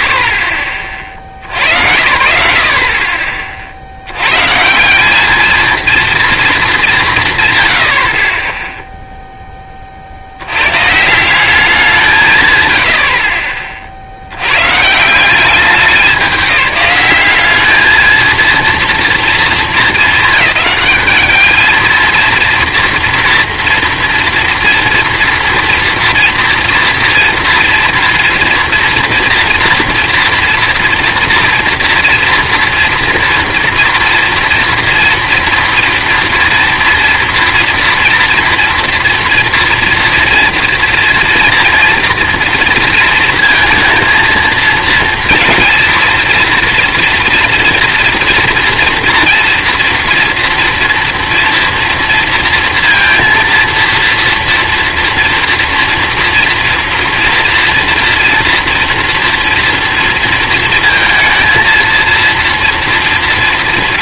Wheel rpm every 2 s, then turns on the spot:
90, 70, 230, 120, 10, 190, 30, 180, 210, 220, 210, 230, 240, 230, 230, 230, 230, 230, 230, 230, 240, 230, 230, 230, 230, 230, 230, 230, 240, 230, 230, 240.
none